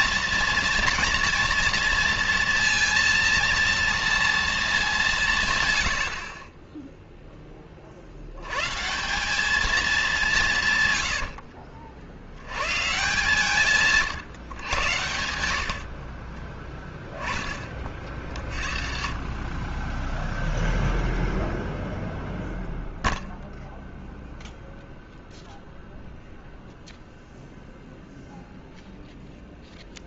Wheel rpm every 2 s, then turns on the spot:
240, 230, 230, 30, 110, 160, 100, 120, 10, 40, 0, 0, 0, 0, 0.
none